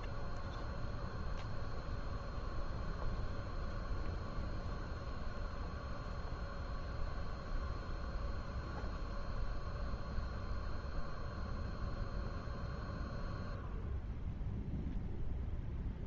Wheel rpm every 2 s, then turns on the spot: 0, 0, 0, 0, 0, 0, 0, 0.
none